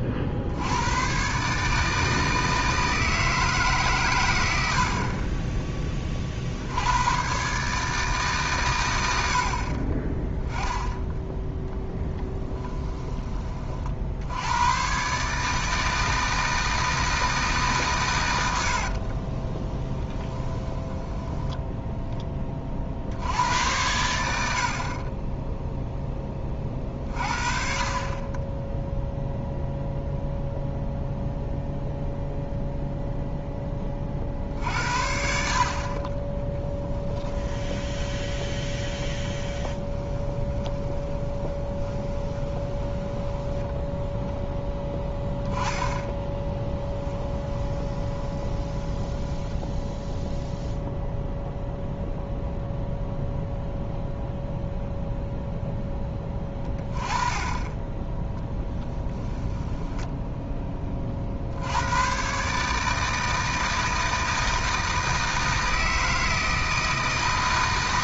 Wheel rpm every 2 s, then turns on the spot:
100, 160, 60, 90, 110, 10, 10, 110, 160, 70, 10, 50, 40, 30, 0, 0, 0, 60, 10, 10, 20, 20, 10, 10, 10, 0, 0, 0, 20, 10, 20, 150, 160, 160.
18-22 40-44 46-50 58-60